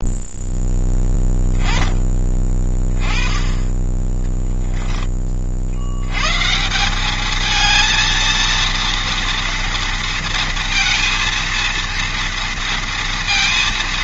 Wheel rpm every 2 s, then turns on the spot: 10, 20, 10, 160, 230, 230, 230.
4-6